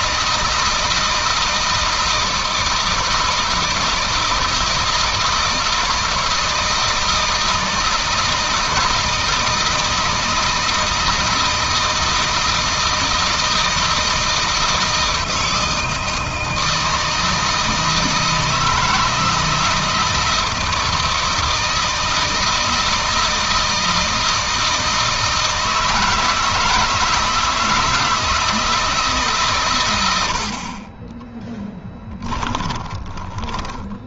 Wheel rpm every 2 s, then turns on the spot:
160, 160, 160, 160, 160, 160, 160, 160, 160, 160, 160, 160, 160, 160, 150, 40, 20.
30-34